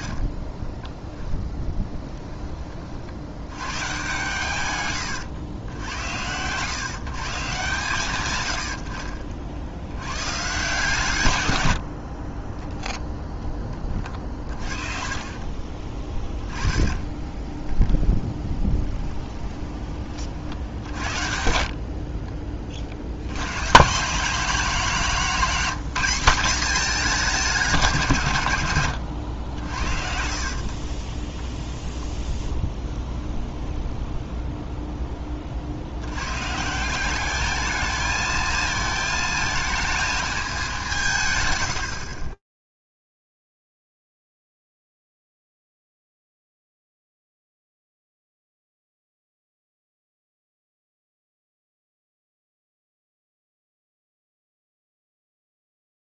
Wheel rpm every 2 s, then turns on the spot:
10, 30, 150, 130, 90, 140, 10, 40, 20, 10, 60, 50, 200, 210, 110, 30, 10, 10, 160, 220, 190, 10, 0, 0, 0, 0, 0, 0.
0-2 8-10 14-20 30-34